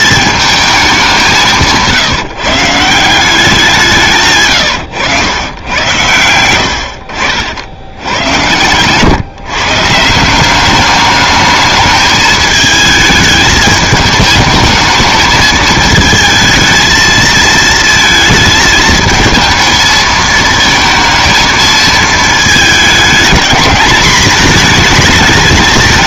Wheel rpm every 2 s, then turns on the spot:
210, 150, 120, 80, 110, 190, 220, 220, 220, 220, 220, 220, 220.
none